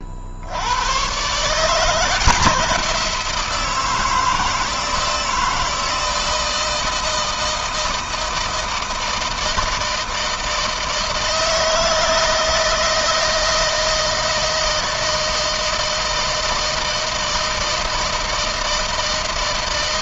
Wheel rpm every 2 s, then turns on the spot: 120, 170, 160, 160, 160, 160, 160, 160, 160, 160.
none